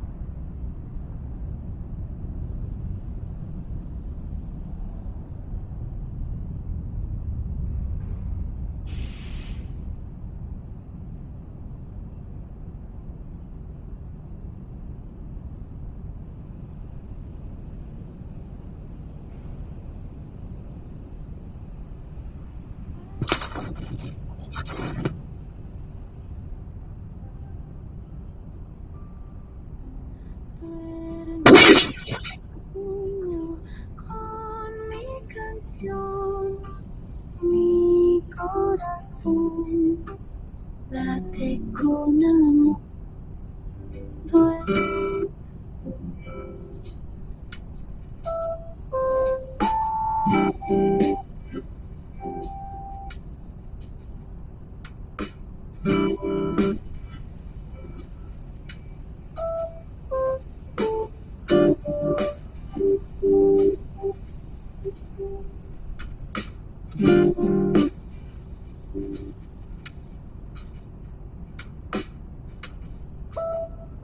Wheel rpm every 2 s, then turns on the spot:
0, 0, 0, 0, 0, 0, 0, 0, 0, 0, 0, 0, 0, 0, 0, 0, 0, 0, 0, 0, 0, 0, 0, 0, 0, 0, 0, 0, 0, 0, 0, 0, 0, 0, 0, 0, 0.
none